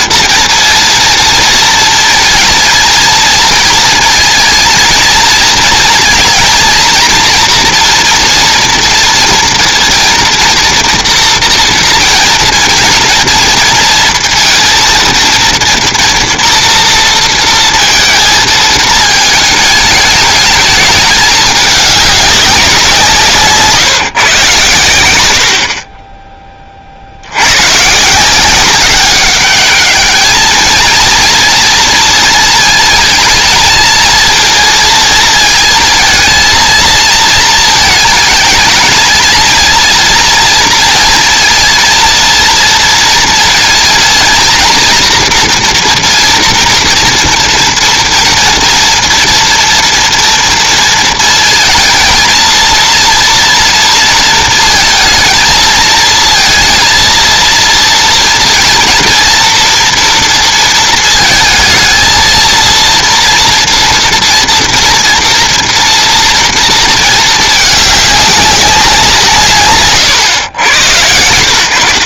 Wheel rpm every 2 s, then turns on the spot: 230, 230, 230, 230, 230, 230, 230, 230, 230, 210, 210, 160, 100, 60, 190, 230, 230, 220, 220, 220, 230, 230, 240, 230, 230, 230, 230, 220, 230, 230, 220, 230, 230, 220, 170, 100.
none